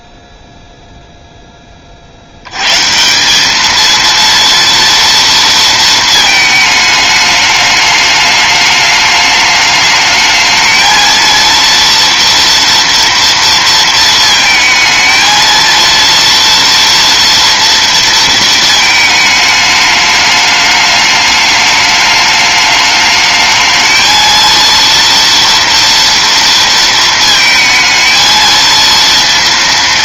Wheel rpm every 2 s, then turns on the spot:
20, 220, 230, 210, 210, 230, 230, 230, 230, 210, 210, 220, 230, 220, 230.
none